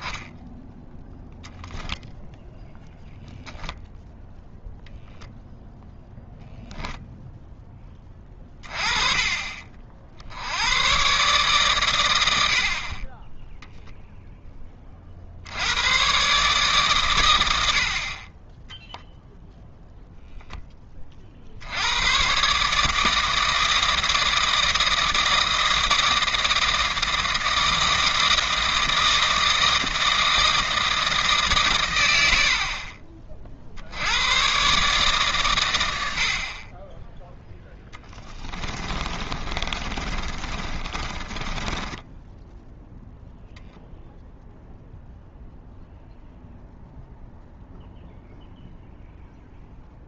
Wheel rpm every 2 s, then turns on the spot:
0, 0, 0, 0, 30, 100, 50, 20, 140, 10, 10, 150, 160, 160, 160, 160, 50, 140, 30, 30, 30, 0, 0, 0, 0.
38-42